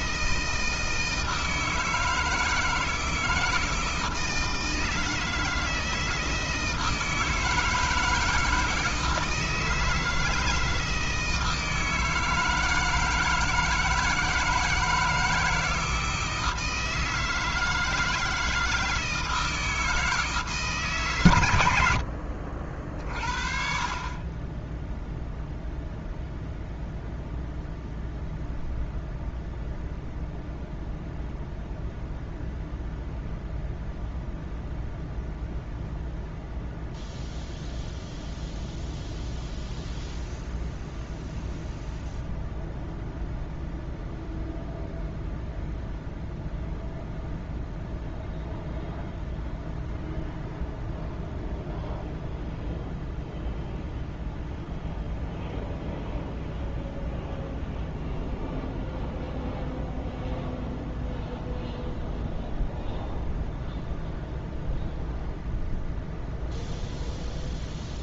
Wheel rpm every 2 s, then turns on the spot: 160, 160, 160, 160, 160, 160, 160, 160, 160, 160, 150, 50, 10, 0, 0, 0, 0, 0, 0, 0, 0, 0, 0, 0, 0, 0, 0, 0, 0, 0, 0, 0, 0, 0.
none